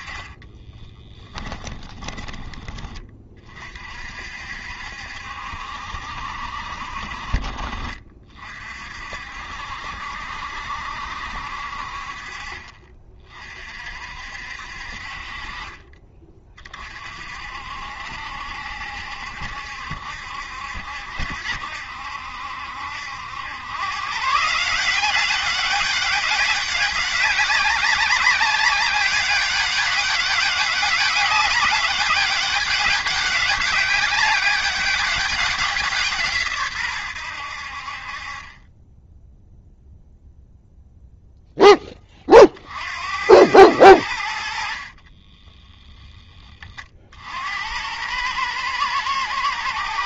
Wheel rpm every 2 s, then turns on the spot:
20, 30, 70, 50, 50, 70, 40, 50, 40, 70, 70, 80, 190, 200, 200, 200, 200, 200, 110, 10, 0, 70, 30, 40, 110.
0-2 44-46